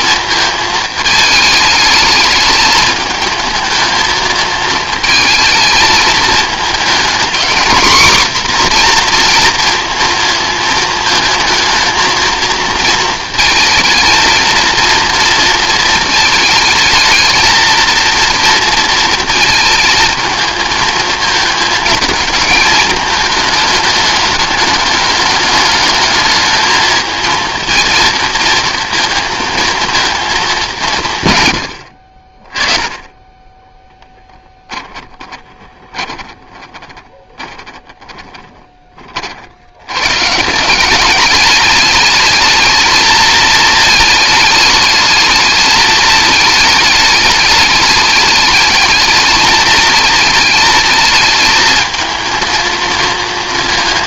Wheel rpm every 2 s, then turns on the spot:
220, 220, 230, 230, 250, 220, 230, 230, 220, 230, 220, 220, 210, 220, 230, 170, 20, 10, 20, 20, 150, 220, 210, 210, 210, 220, 230.
34-40